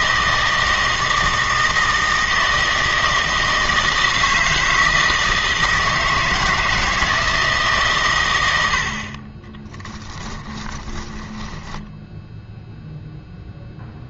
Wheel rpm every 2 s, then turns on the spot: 160, 160, 160, 160, 80, 10, 0.
10-12